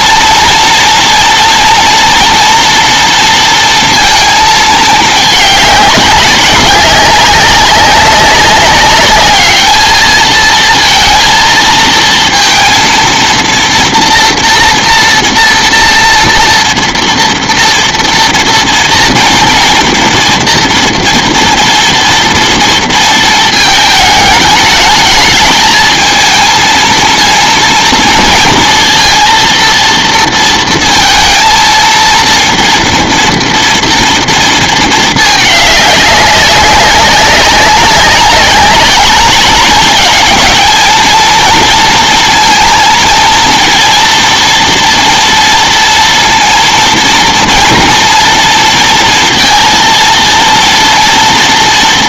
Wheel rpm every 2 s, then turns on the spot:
230, 230, 220, 190, 200, 230, 230, 240, 230, 230, 230, 230, 210, 230, 230, 230, 230, 220, 200, 190, 220, 230, 230, 230, 230, 230.
none